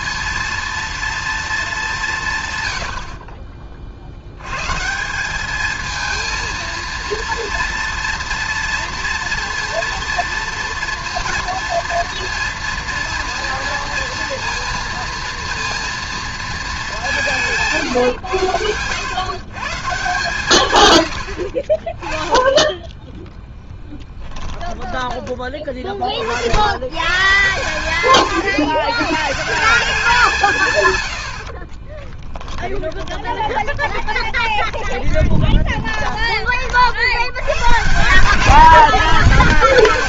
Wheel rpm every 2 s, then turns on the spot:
230, 130, 120, 230, 240, 230, 230, 230, 220, 110, 130, 10, 10, 80, 130, 150, 10, 20, 30, 160.
24-26 32-36